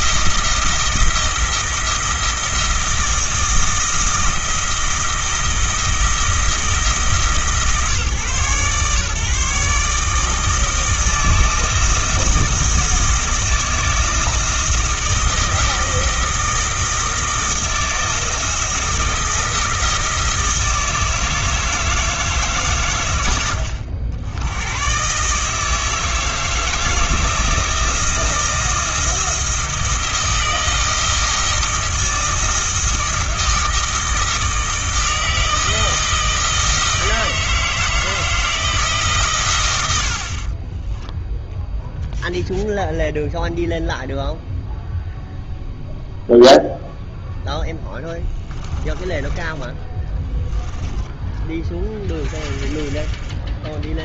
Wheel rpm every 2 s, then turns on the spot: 170, 160, 160, 160, 140, 160, 160, 160, 160, 160, 160, 120, 110, 160, 160, 160, 160, 160, 160, 160, 20, 0, 0, 0, 20, 10, 30.
40-42 48-52